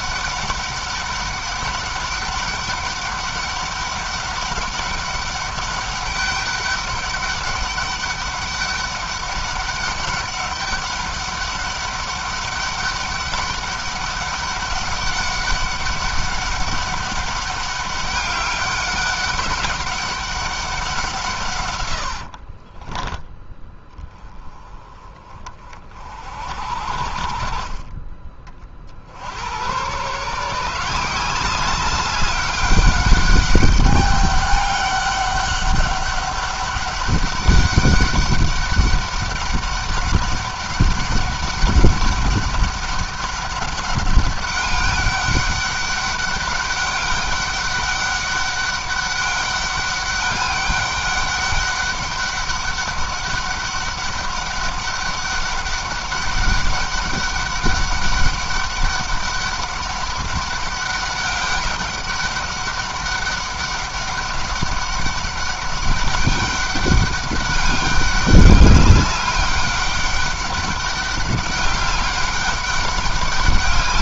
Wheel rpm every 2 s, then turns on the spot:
200, 200, 200, 200, 200, 200, 200, 200, 200, 200, 190, 40, 30, 70, 60, 170, 200, 200, 200, 200, 200, 200, 200, 200, 200, 200, 200, 200, 200, 200, 200, 200, 200, 200, 200, 200, 200.
22-24